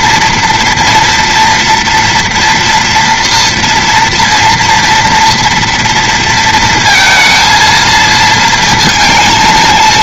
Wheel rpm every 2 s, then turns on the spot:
230, 240, 230, 220, 220.
none